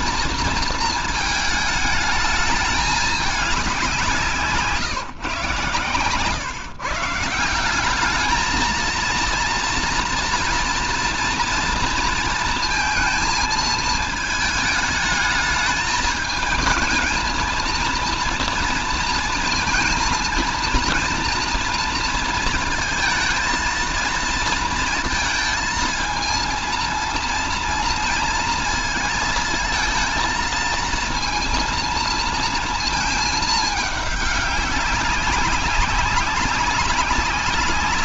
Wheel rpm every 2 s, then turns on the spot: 230, 210, 150, 150, 230, 230, 230, 220, 220, 230, 230, 230, 230, 230, 230, 230, 220, 200, 190.
none